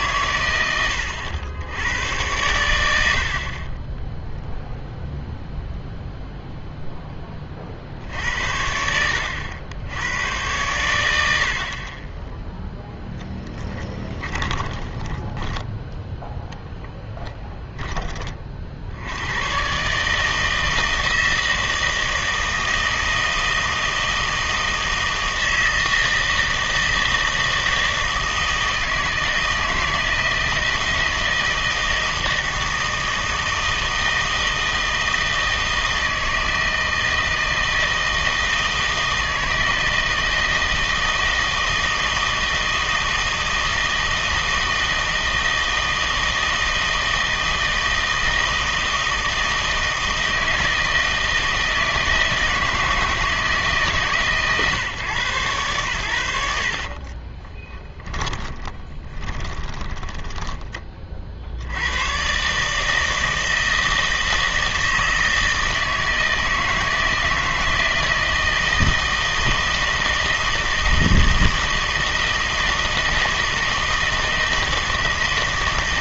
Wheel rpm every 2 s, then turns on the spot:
100, 100, 0, 0, 70, 110, 0, 20, 10, 60, 160, 160, 160, 160, 160, 160, 160, 160, 160, 160, 160, 160, 160, 160, 160, 160, 160, 140, 70, 20, 20, 150, 160, 160, 160, 160, 160, 160.
14-16 56-60